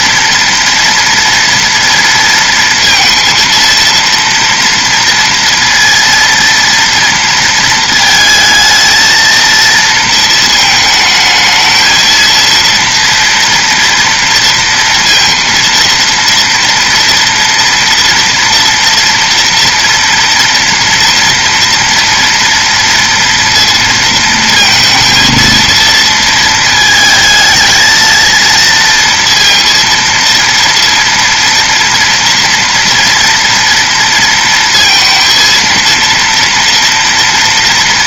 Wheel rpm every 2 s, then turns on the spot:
230, 230, 230, 230, 220, 220, 230, 230, 230, 230, 230, 230, 220, 220, 230, 230, 230, 230, 230.
none